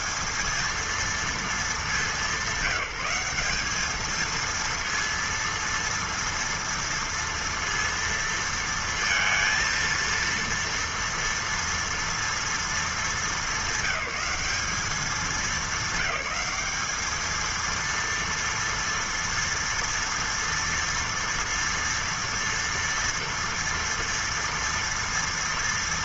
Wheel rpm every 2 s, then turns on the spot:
220, 190, 230, 230, 230, 230, 230, 200, 210, 230, 230, 230, 230.
none